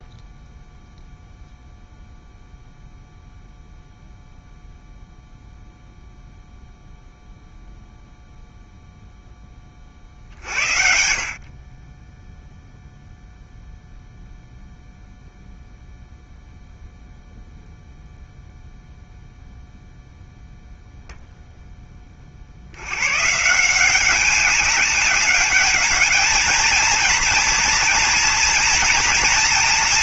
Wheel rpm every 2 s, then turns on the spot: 0, 0, 0, 0, 0, 50, 0, 0, 0, 0, 0, 50, 200, 220, 230.
none